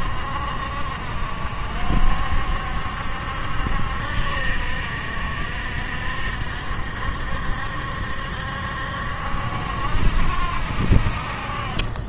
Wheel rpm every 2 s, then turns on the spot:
60, 70, 60, 70, 70, 60.
none